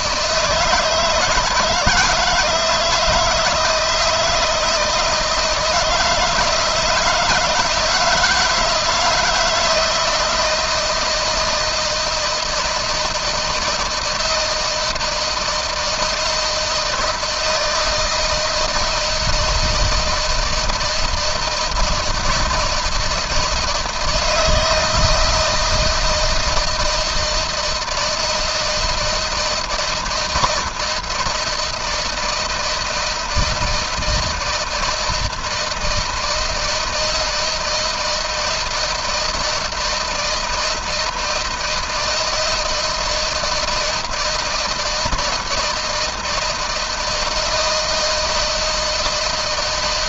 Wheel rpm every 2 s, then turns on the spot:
160, 160, 160, 160, 160, 160, 170, 160, 160, 160, 160, 160, 160, 160, 170, 160, 160, 160, 160, 160, 160, 160, 160, 160, 160.
none